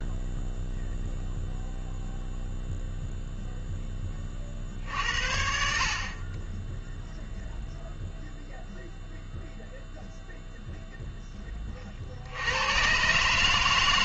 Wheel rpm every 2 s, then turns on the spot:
0, 0, 60, 10, 0, 0, 110.
none